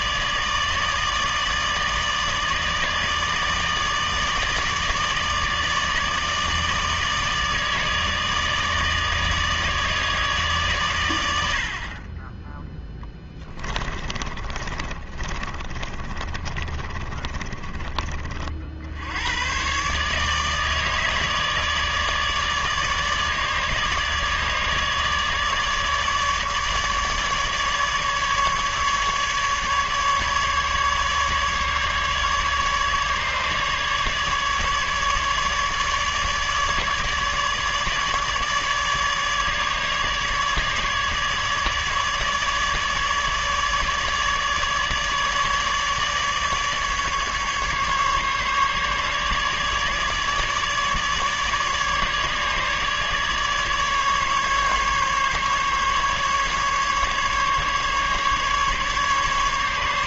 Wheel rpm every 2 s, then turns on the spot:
150, 150, 150, 160, 150, 140, 10, 30, 30, 50, 150, 150, 150, 150, 150, 150, 150, 150, 150, 150, 150, 150, 150, 150, 150, 150, 150, 140, 150, 140.
12-18